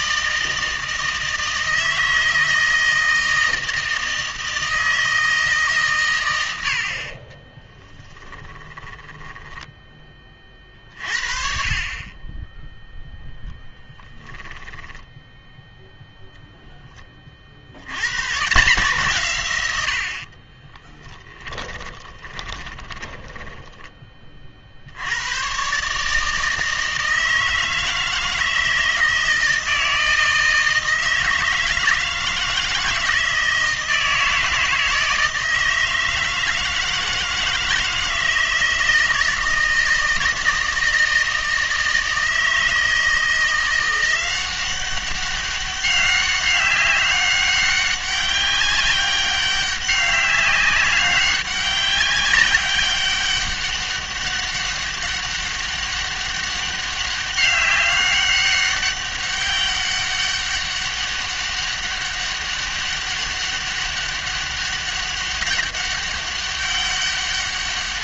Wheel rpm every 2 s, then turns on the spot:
160, 160, 160, 90, 20, 30, 10, 10, 0, 150, 20, 20, 50, 160, 160, 160, 160, 160, 160, 160, 160, 160, 190, 200, 200, 200, 190, 200, 200, 200, 200, 200, 200, 200.
8-10 14-16 20-24